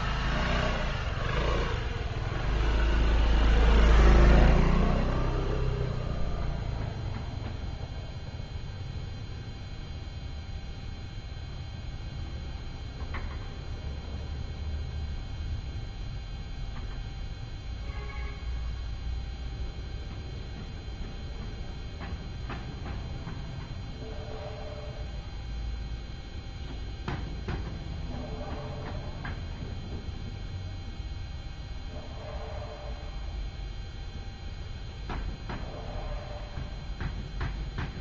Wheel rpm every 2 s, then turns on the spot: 0, 0, 0, 0, 0, 0, 0, 0, 0, 0, 0, 0, 0, 0, 0, 0, 0, 0, 0.
none